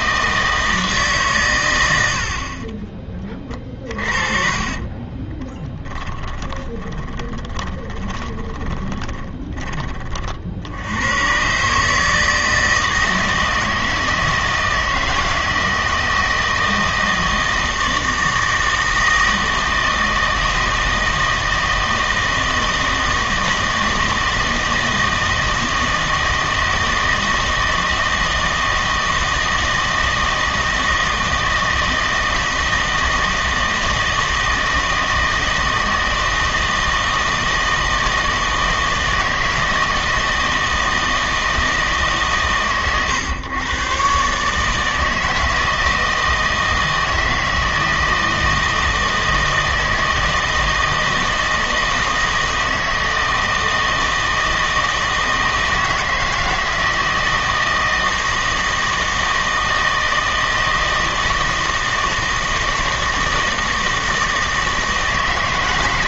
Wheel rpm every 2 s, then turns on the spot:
160, 30, 30, 20, 10, 80, 160, 160, 160, 160, 160, 160, 160, 160, 160, 160, 160, 160, 160, 160, 160, 120, 150, 160, 160, 160, 160, 160, 160, 160, 160, 160, 160.
4-10